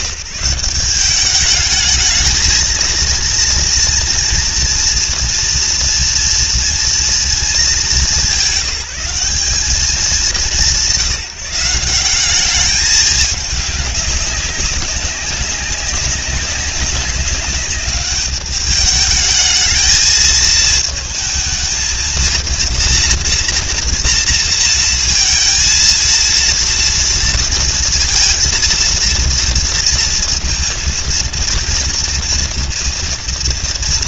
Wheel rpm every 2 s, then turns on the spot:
140, 220, 240, 230, 180, 160, 200, 200, 200, 210, 220, 230, 220, 230, 230, 230, 230.
none